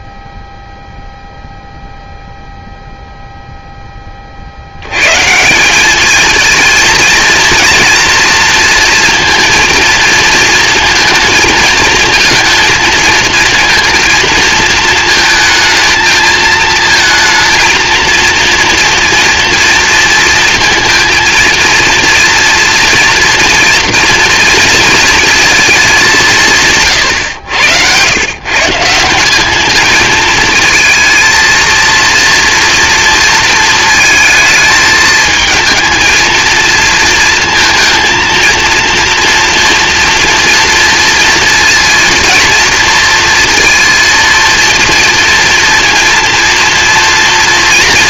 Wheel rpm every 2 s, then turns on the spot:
0, 0, 110, 230, 230, 230, 230, 220, 220, 230, 230, 230, 230, 130, 170, 220, 230, 220, 230, 230, 230, 230, 230, 230.
none